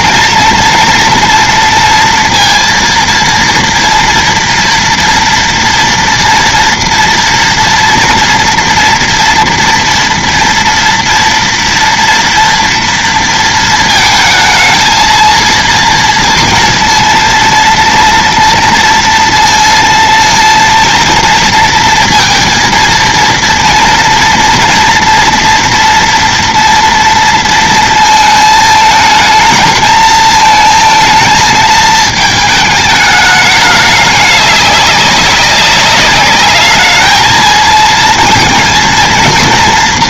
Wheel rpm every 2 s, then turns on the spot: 230, 230, 240, 230, 240, 230, 230, 230, 230, 240, 230, 230, 230, 230, 220, 220, 220, 200, 210, 220.
none